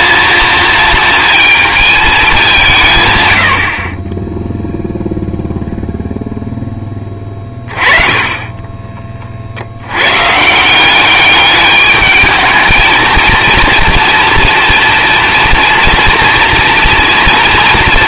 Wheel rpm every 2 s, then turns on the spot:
220, 170, 0, 10, 20, 160, 220, 240, 230.
8-10